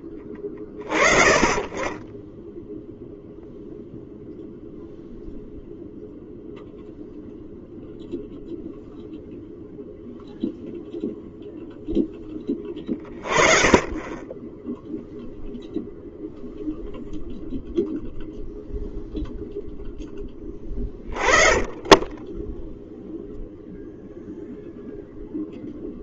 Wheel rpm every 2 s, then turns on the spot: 10, 0, 0, 0, 0, 0, 10, 0, 0, 0, 10, 0, 0.
none